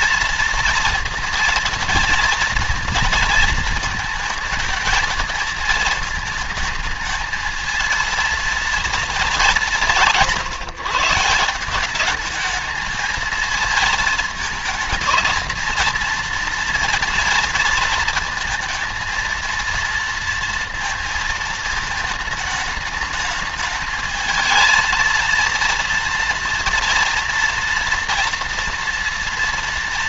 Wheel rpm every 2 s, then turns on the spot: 230, 230, 220, 220, 230, 160, 210, 220, 230, 230, 230, 210, 220, 230, 230.
none